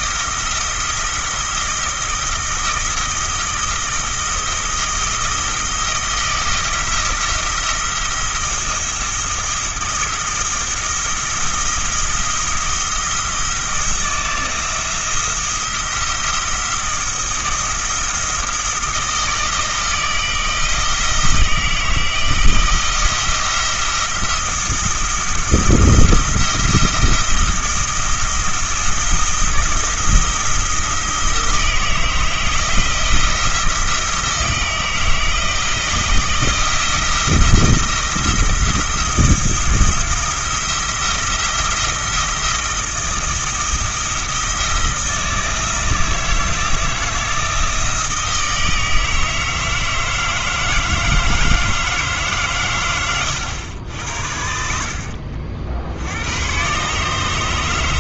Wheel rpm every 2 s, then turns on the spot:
170, 160, 160, 170, 170, 160, 170, 170, 170, 160, 160, 170, 170, 170, 170, 160, 170, 160, 170, 170, 170, 160, 160, 160, 160, 160, 110, 60, 130.
54-56